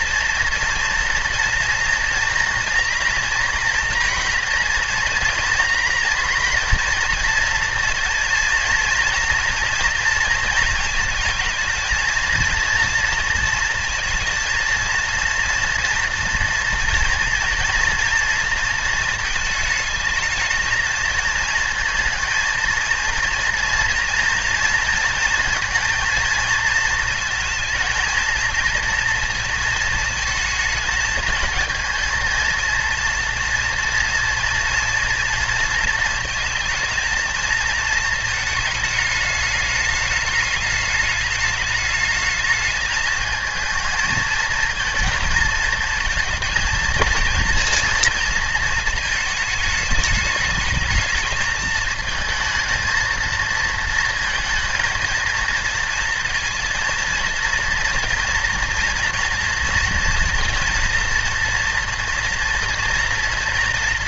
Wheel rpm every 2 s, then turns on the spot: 230, 240, 240, 230, 230, 220, 230, 230, 230, 230, 220, 230, 230, 230, 230, 220, 230, 230, 230, 220, 210, 220, 230, 230, 220, 220, 220, 230, 230, 230, 230, 230.
none